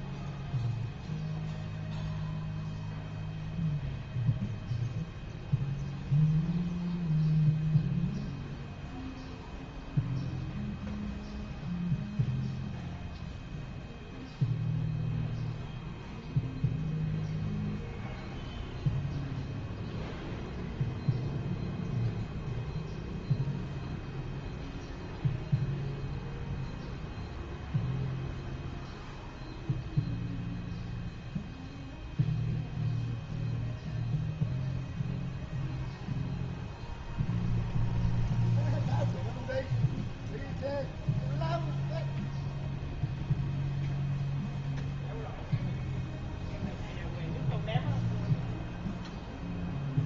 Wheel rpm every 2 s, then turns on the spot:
0, 0, 0, 0, 0, 0, 0, 0, 0, 0, 0, 0, 0, 0, 0, 0, 0, 0, 0, 0, 0, 0, 0, 0, 0.
none